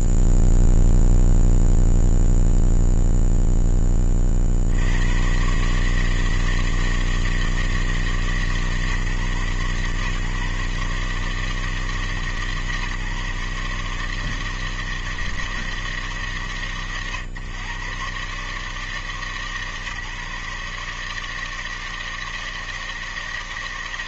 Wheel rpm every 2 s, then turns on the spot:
0, 0, 0, 120, 160, 130, 150, 150, 160, 110, 140, 160.
none